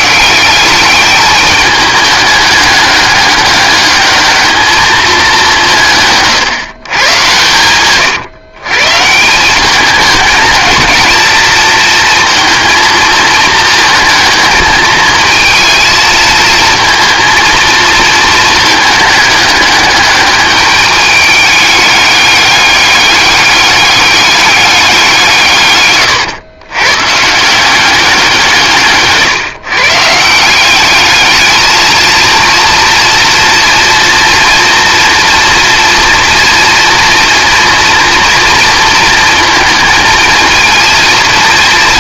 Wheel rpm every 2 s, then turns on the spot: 210, 210, 210, 120, 140, 220, 220, 220, 230, 210, 210, 200, 190, 130, 150, 200, 240, 230, 230, 230, 230.
28-30